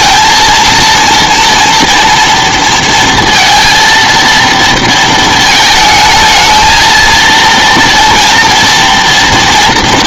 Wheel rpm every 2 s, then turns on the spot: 220, 230, 230, 220, 230.
none